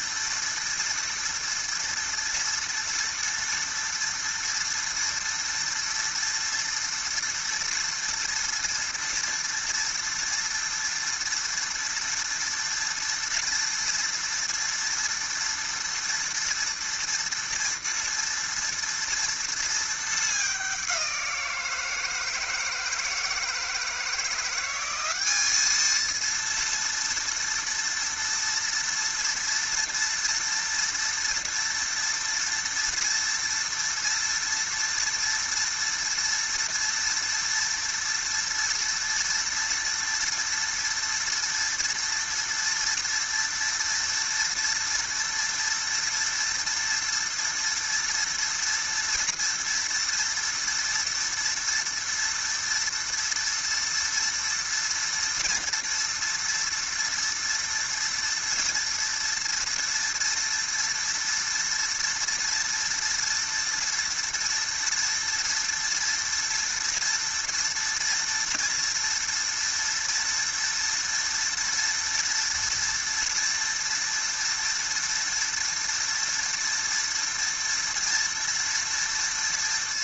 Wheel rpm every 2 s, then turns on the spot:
230, 230, 230, 230, 230, 230, 230, 230, 230, 230, 210, 160, 170, 230, 230, 230, 230, 230, 230, 230, 230, 230, 230, 230, 230, 230, 230, 230, 230, 230, 240, 230, 230, 230, 230, 230, 230, 230, 230, 230.
none